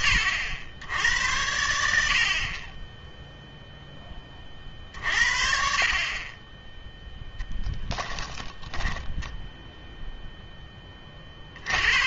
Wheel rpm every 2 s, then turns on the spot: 90, 20, 50, 10, 10, 20.
8-10